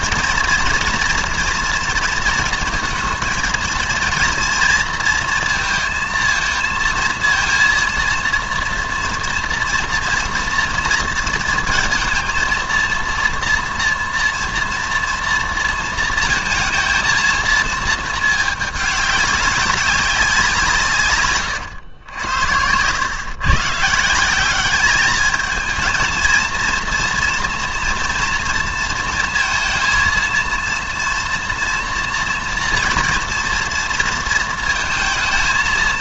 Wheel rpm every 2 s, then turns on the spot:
230, 230, 230, 230, 230, 230, 230, 230, 220, 210, 170, 100, 200, 230, 230, 230, 240, 230.
none